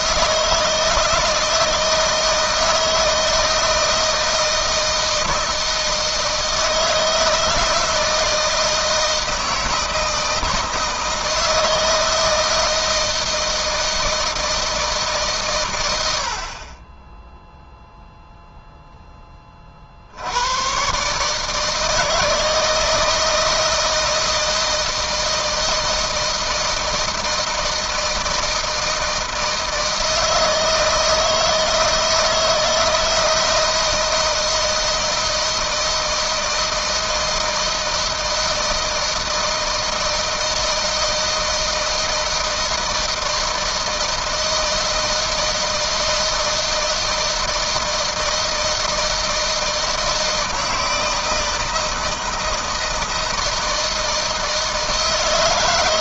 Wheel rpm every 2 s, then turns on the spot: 160, 160, 160, 160, 160, 160, 160, 150, 20, 10, 130, 160, 160, 160, 160, 160, 160, 160, 160, 160, 160, 160, 160, 160, 160, 160, 160, 160.
none